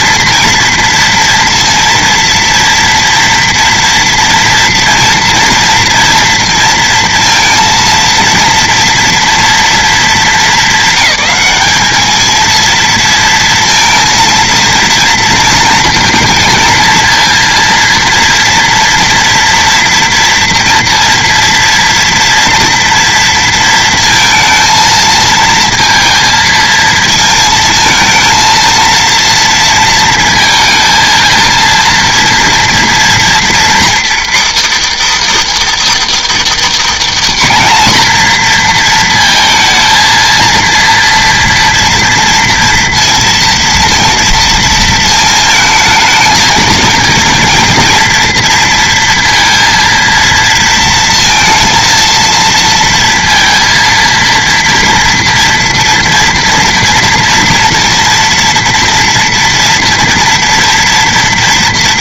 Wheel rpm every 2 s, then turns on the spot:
230, 230, 230, 230, 230, 210, 230, 230, 230, 230, 230, 230, 220, 230, 230, 230, 230, 320, 300, 230, 230, 230, 230, 220, 230, 230, 230, 230, 230, 230, 230.
none